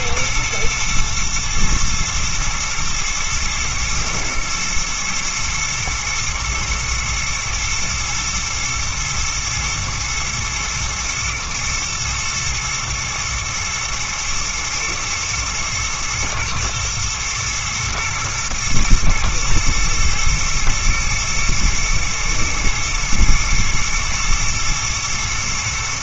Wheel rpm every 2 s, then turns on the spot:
110, 110, 120, 110, 110, 110, 110, 110, 110, 110, 110, 110, 120.
none